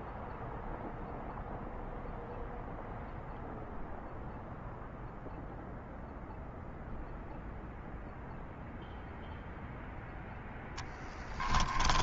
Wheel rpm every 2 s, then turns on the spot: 0, 0, 0, 0, 0, 10.
10-12